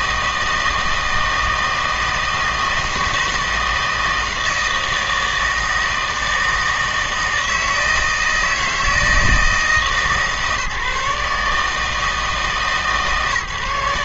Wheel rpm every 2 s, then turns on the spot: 160, 160, 160, 160, 160, 150, 150.
none